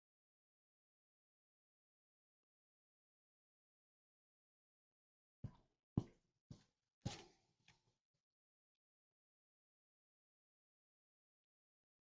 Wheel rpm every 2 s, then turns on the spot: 0, 0, 0, 0, 0, 0.
none